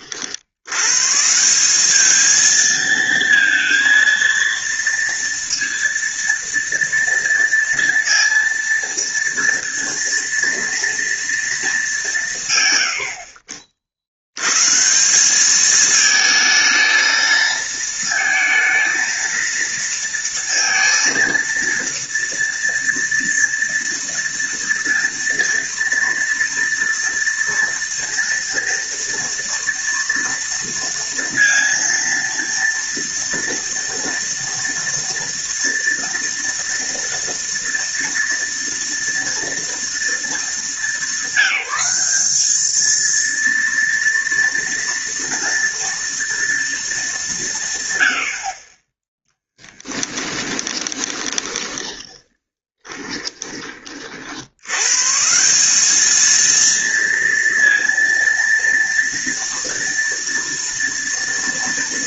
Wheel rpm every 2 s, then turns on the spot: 130, 230, 230, 230, 230, 230, 100, 160, 220, 230, 230, 230, 230, 230, 230, 230, 230, 230, 230, 230, 220, 220, 230, 220, 20, 20, 20, 130, 230, 230, 230.
50-54